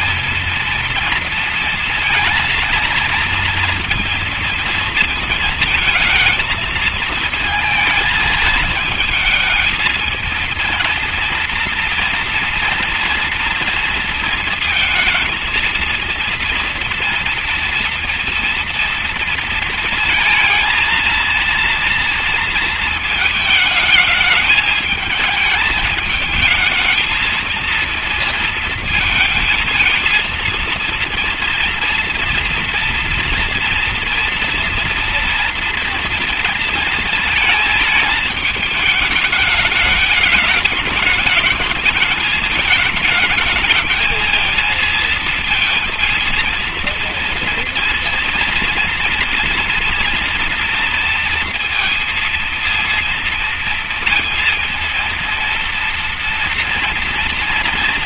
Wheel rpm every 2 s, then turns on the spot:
230, 230, 230, 220, 210, 230, 230, 230, 230, 230, 230, 230, 210, 220, 230, 230, 230, 230, 230, 210, 220, 220, 220, 230, 230, 230, 230, 230, 230.
none